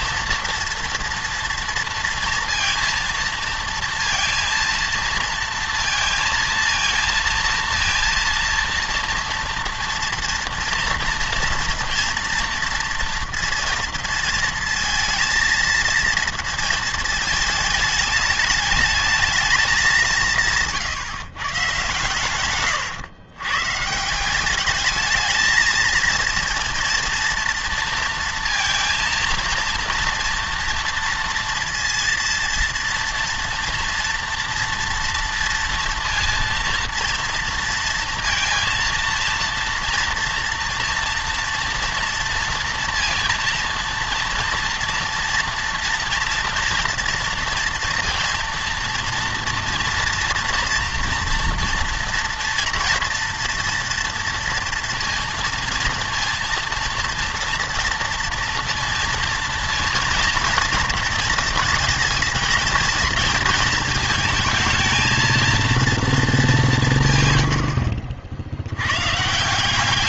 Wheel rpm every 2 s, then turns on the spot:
230, 230, 230, 230, 230, 230, 230, 230, 230, 220, 160, 120, 200, 230, 230, 230, 230, 230, 230, 230, 240, 230, 230, 230, 230, 240, 230, 230, 230, 230, 230, 230, 220, 190, 100.
none